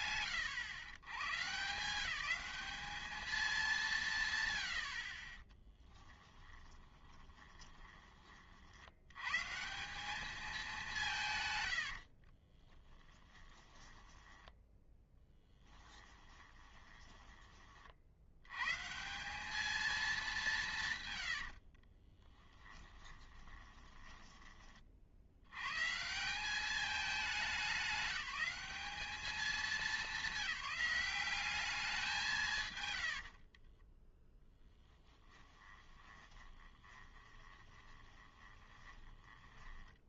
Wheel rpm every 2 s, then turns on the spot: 120, 210, 40, 20, 110, 150, 10, 10, 20, 180, 130, 20, 70, 210, 200, 190, 80, 10, 20, 10.
6-8 12-18 20-24 32-40